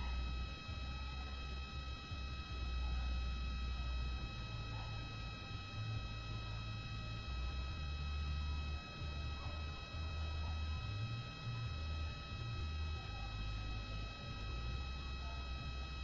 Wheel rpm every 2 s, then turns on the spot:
0, 0, 0, 0, 0, 0, 0, 0.
none